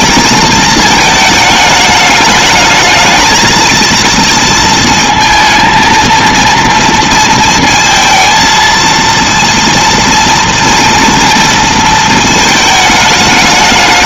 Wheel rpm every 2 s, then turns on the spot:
220, 220, 230, 230, 230, 230, 210.
none